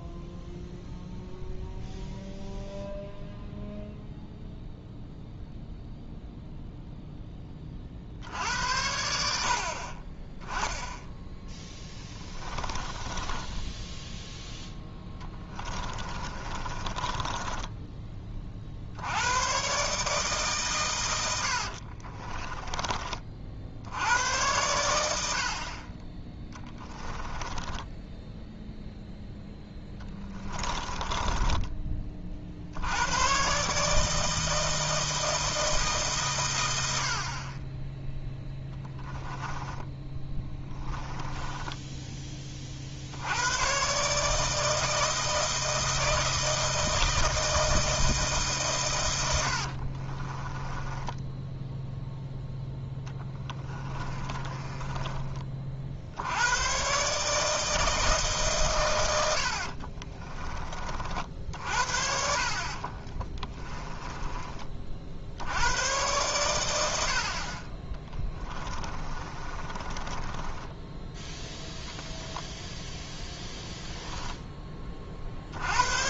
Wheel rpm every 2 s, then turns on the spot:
0, 0, 0, 0, 70, 10, 20, 10, 30, 70, 120, 30, 90, 10, 0, 20, 90, 160, 80, 10, 10, 60, 160, 160, 110, 10, 10, 20, 130, 120, 40, 40, 50, 70, 20, 10, 0, 30.
12-18 26-28 30-32 38-42 50-52 54-56 62-64 68-72